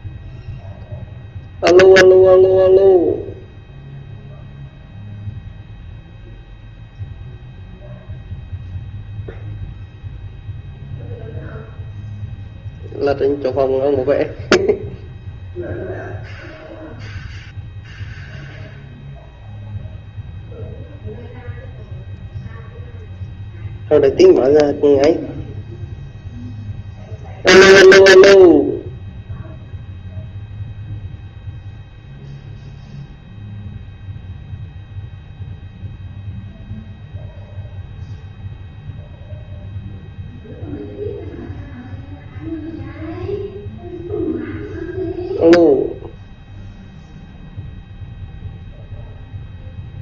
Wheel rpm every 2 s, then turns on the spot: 0, 0, 0, 0, 0, 0, 0, 0, 0, 0, 0, 0, 0, 0, 0, 0, 0, 0, 0, 0, 0, 0, 0, 0, 0.
none